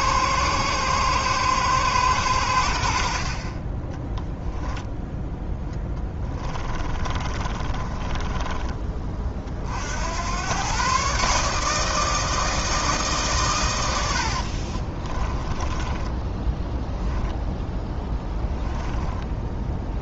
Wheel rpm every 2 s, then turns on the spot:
120, 70, 0, 20, 30, 130, 160, 50, 10, 10.
6-8 14-20